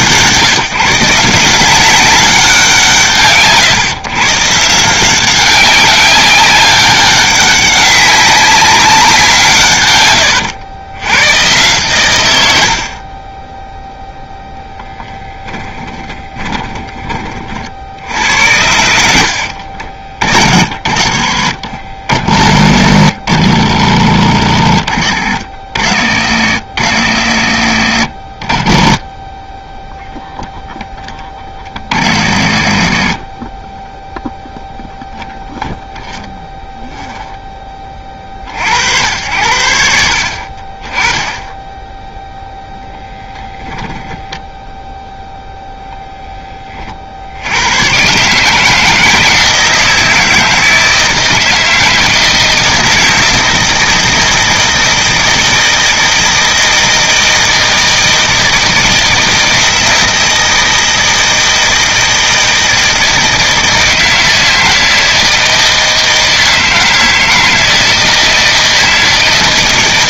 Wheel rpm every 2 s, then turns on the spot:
160, 170, 160, 200, 200, 110, 80, 0, 20, 80, 40, 40, 40, 70, 30, 0, 50, 0, 0, 60, 30, 0, 0, 30, 160, 160, 160, 160, 160, 160, 160, 160, 160, 160, 160.
16-18